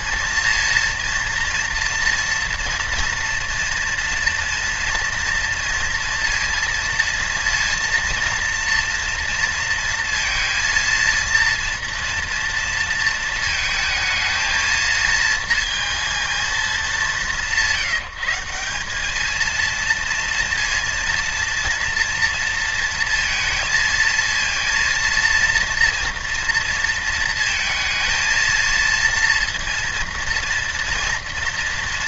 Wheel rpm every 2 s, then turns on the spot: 230, 230, 230, 230, 240, 230, 230, 220, 200, 190, 230, 230, 230, 230, 230, 230.
none